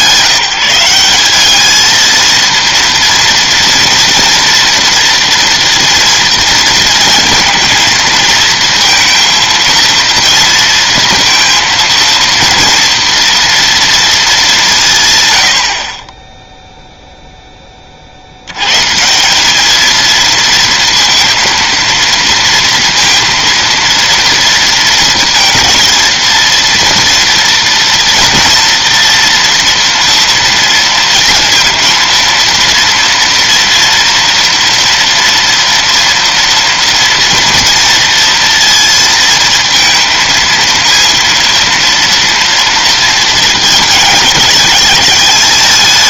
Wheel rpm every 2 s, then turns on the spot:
180, 230, 230, 230, 230, 230, 230, 190, 0, 100, 230, 230, 230, 230, 230, 240, 230, 230, 230, 230, 230, 230, 200.
none